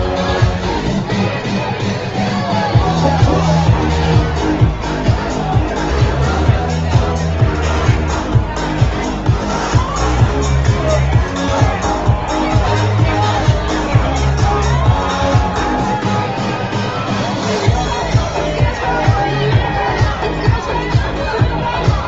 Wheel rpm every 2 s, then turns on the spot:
0, 0, 0, 0, 0, 0, 0, 0, 0, 0, 0.
none